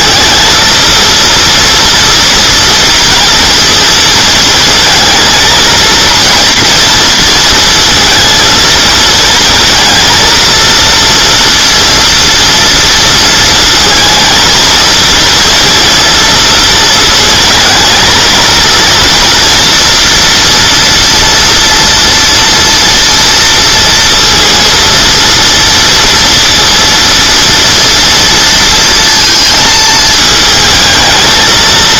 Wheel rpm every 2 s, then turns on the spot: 230, 230, 230, 230, 230, 230, 230, 230, 230, 230, 240, 230, 230, 230, 230, 220.
none